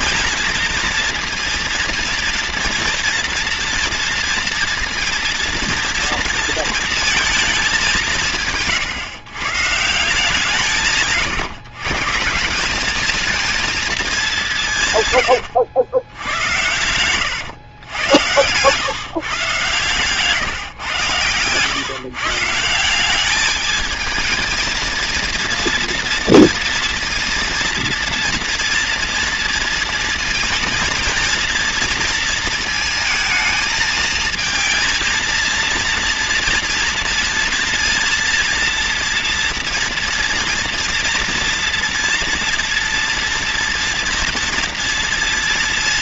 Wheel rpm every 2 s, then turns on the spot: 230, 230, 230, 230, 140, 150, 180, 150, 90, 110, 140, 160, 230, 230, 230, 230, 220, 230, 230, 240, 230, 230, 230.
16-18